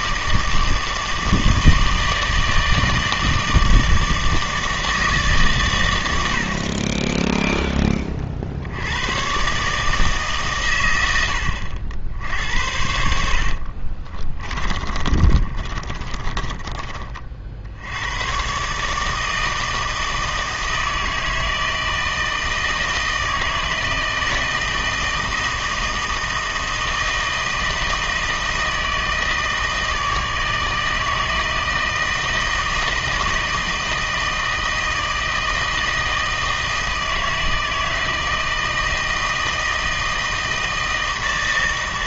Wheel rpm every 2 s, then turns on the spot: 160, 160, 160, 50, 70, 120, 70, 20, 20, 130, 160, 160, 160, 160, 160, 160, 160, 160, 160, 160, 160.
14-18